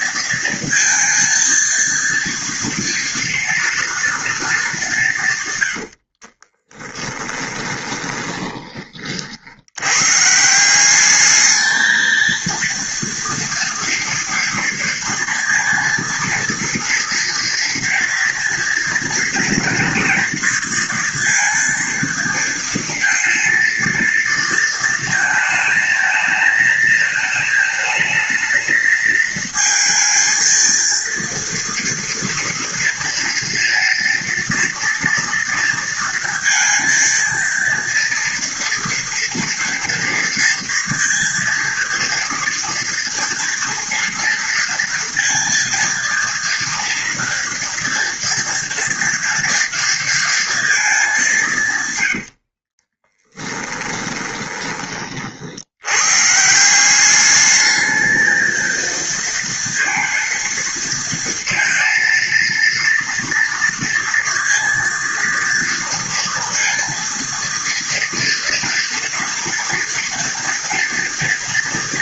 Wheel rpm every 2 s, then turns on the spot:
230, 230, 210, 30, 20, 160, 230, 230, 230, 240, 230, 230, 230, 220, 220, 230, 230, 230, 230, 230, 230, 240, 230, 230, 240, 230, 60, 20, 160, 220, 230, 230, 230, 230, 230, 230.
6-10 52-54